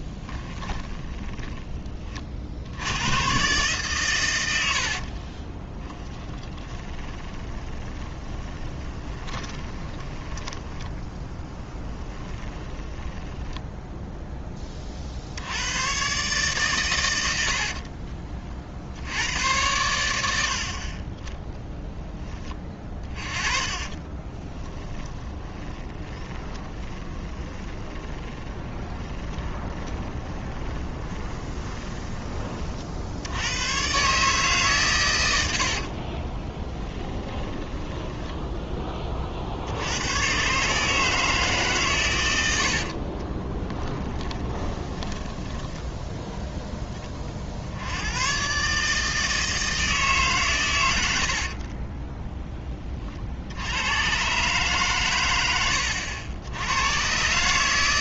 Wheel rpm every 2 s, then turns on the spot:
20, 90, 80, 20, 20, 10, 10, 20, 120, 60, 40, 30, 10, 20, 20, 20, 60, 120, 20, 20, 150, 50, 20, 20, 140, 110, 30, 130, 100.
0-2 6-14 22-32 36-38 42-46